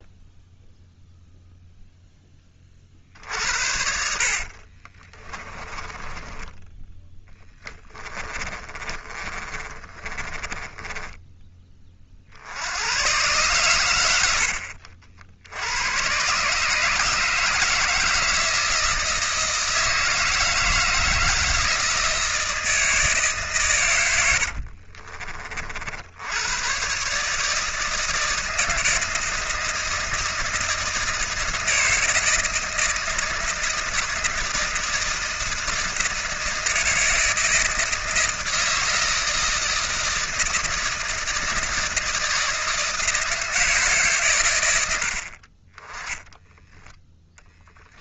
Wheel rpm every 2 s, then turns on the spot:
0, 50, 30, 10, 30, 20, 100, 60, 150, 160, 160, 160, 60, 130, 170, 160, 160, 160, 160, 160, 160, 160, 80, 10.
4-6 8-12 24-26